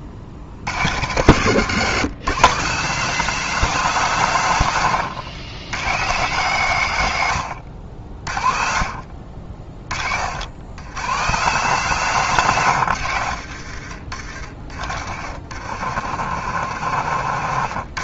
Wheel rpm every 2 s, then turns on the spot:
80, 160, 140, 140, 40, 90, 130, 60, 80.
14-18